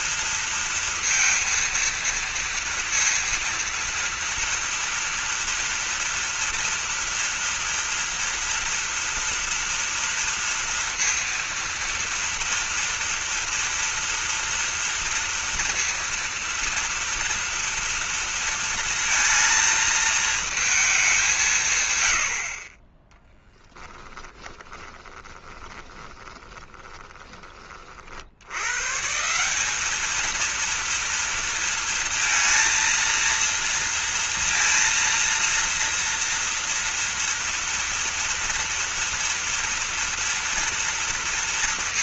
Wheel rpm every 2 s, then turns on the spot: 230, 230, 230, 230, 230, 230, 230, 230, 230, 230, 210, 10, 20, 10, 150, 230, 230, 230, 230, 230, 230.
24-28